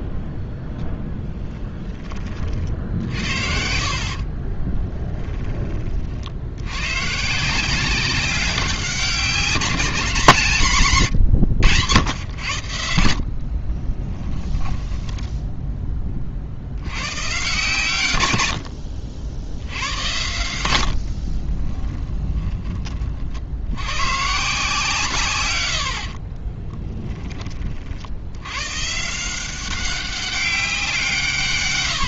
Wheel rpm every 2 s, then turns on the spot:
0, 50, 20, 100, 190, 170, 100, 10, 80, 50, 80, 20, 150, 20, 130, 180.
4-6 14-16 18-20 26-28